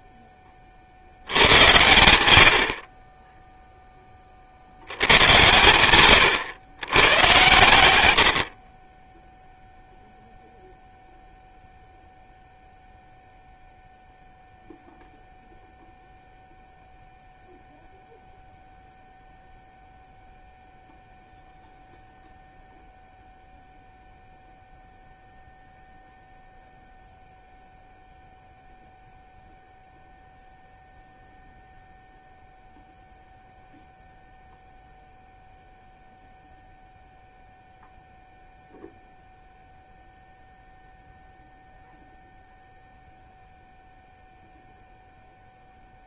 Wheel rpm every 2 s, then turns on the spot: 30, 70, 80, 110, 40, 0, 0, 0, 0, 0, 0, 0, 0, 0, 0, 0, 0, 0, 0, 0, 0, 0, 0.
none